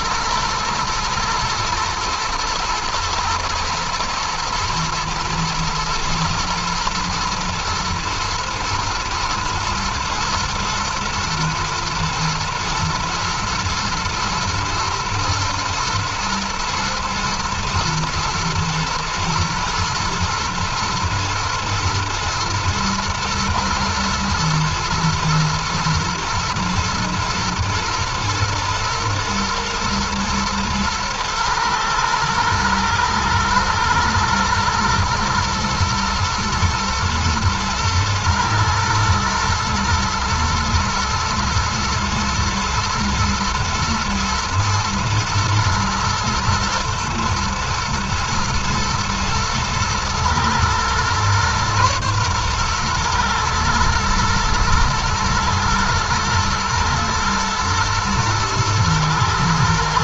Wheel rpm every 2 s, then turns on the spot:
110, 110, 110, 110, 110, 110, 120, 110, 110, 120, 110, 120, 120, 120, 120, 120, 110, 110, 120, 110, 120, 120, 120, 110, 120, 120, 120, 110, 110, 110.
none